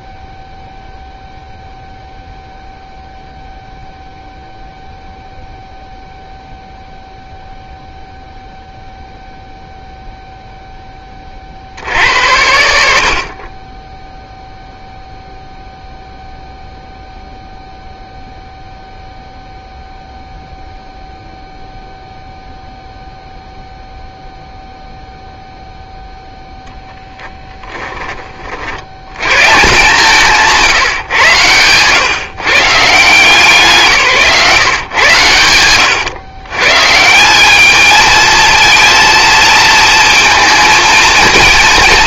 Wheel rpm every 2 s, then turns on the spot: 0, 0, 0, 0, 0, 0, 80, 0, 0, 0, 0, 0, 0, 0, 40, 160, 140, 140, 130, 230, 230.
30-32 34-36